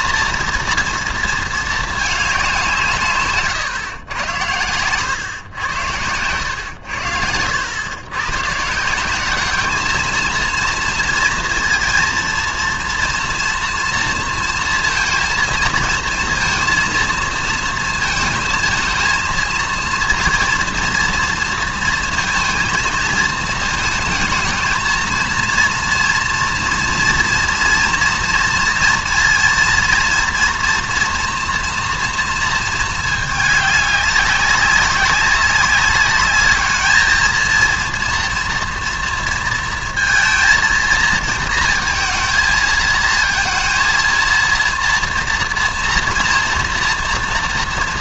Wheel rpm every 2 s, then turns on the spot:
230, 190, 100, 100, 150, 230, 230, 230, 230, 230, 230, 230, 220, 230, 230, 230, 220, 190, 210, 240, 230, 220, 230, 230.
none